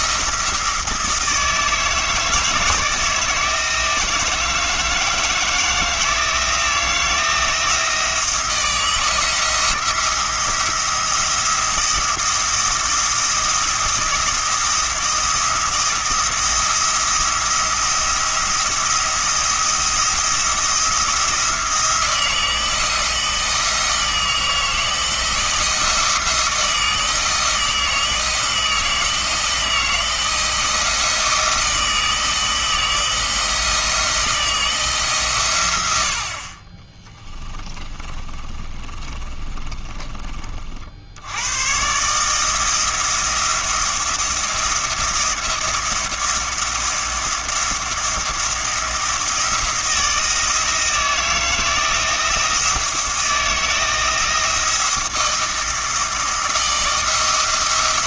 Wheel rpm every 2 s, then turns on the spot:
160, 160, 160, 160, 170, 170, 170, 170, 170, 170, 170, 160, 160, 160, 170, 170, 160, 160, 20, 30, 50, 160, 170, 170, 170, 160, 170, 170, 160.
36-40